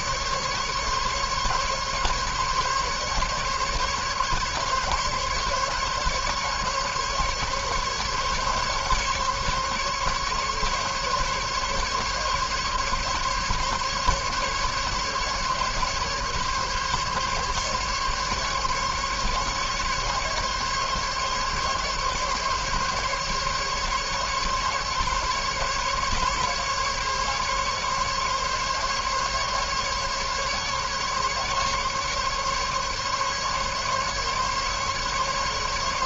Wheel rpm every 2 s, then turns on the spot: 140, 140, 140, 140, 140, 140, 140, 140, 140, 140, 140, 140, 140, 140, 140, 140, 140, 140.
none